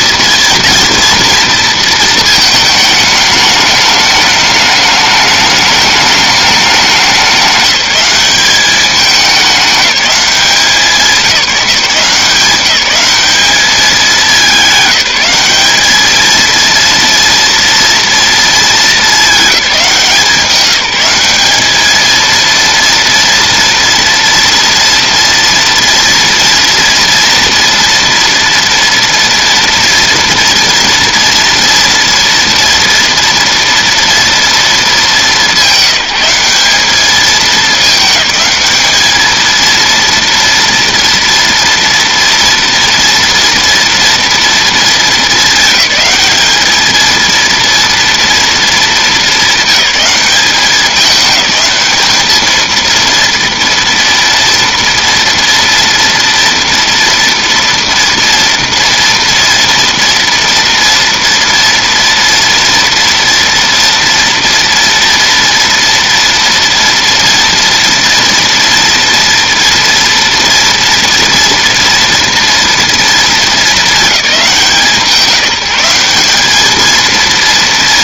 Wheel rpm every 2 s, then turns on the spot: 240, 220, 210, 210, 200, 190, 180, 210, 220, 230, 180, 230, 230, 230, 230, 230, 230, 230, 180, 210, 230, 230, 230, 210, 230, 200, 220, 230, 230, 230, 230, 230, 230, 230, 230, 230, 230, 200, 190.
none